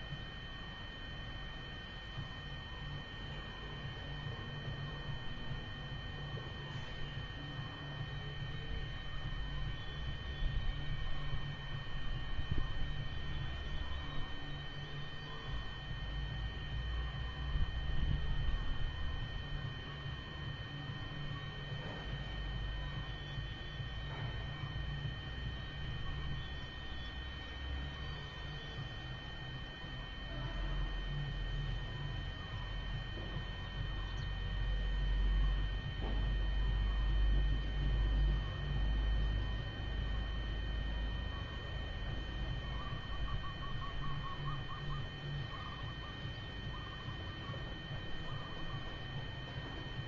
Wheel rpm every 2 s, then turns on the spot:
0, 0, 0, 0, 0, 0, 0, 0, 0, 0, 0, 0, 0, 0, 0, 0, 0, 0, 0, 0, 0, 0, 0, 0, 0.
none